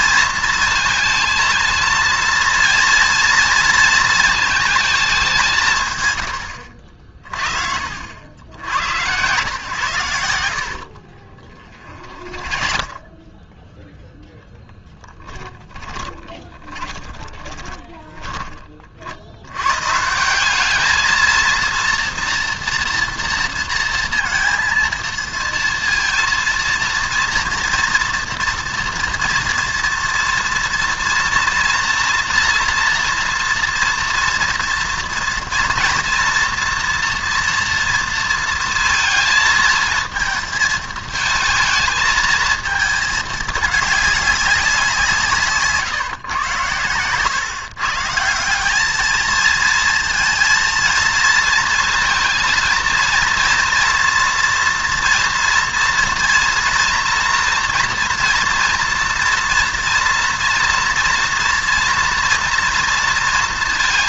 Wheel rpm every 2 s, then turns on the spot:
230, 230, 220, 70, 80, 70, 30, 10, 20, 30, 200, 230, 230, 230, 230, 230, 230, 230, 230, 230, 220, 220, 190, 110, 190, 230, 230, 230, 240, 230, 230, 230.
10-14 16-18